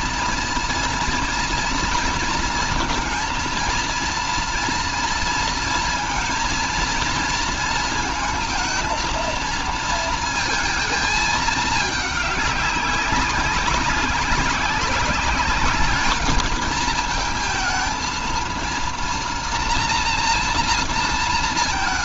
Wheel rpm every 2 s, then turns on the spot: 230, 230, 230, 230, 230, 220, 200, 200, 220, 230, 230.
none